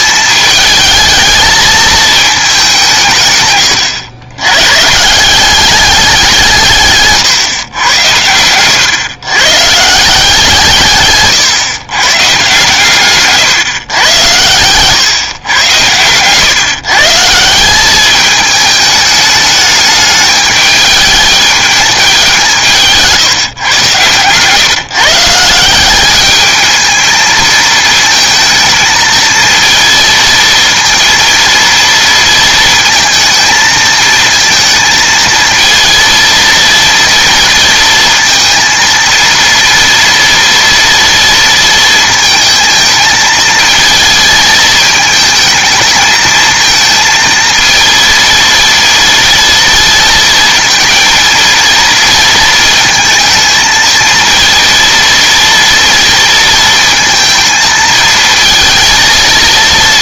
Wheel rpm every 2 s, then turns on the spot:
220, 190, 140, 160, 110, 160, 140, 120, 150, 210, 210, 170, 140, 220, 220, 230, 230, 220, 230, 230, 230, 220, 220, 220, 230, 230, 230, 230, 230, 230.
none